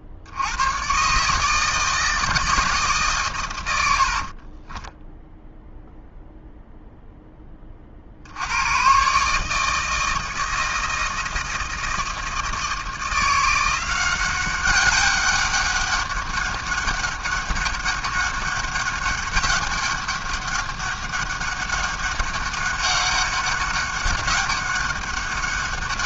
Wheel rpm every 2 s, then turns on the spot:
50, 160, 80, 0, 50, 160, 160, 180, 200, 200, 200, 200, 200.
4-6